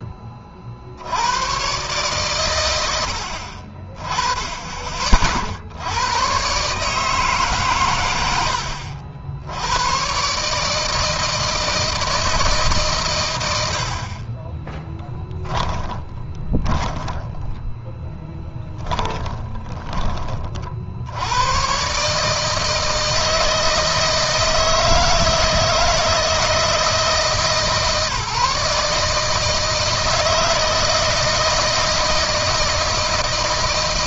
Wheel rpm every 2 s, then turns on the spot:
60, 90, 30, 140, 70, 160, 130, 10, 20, 20, 70, 160, 160, 160, 160, 160, 160.
14-20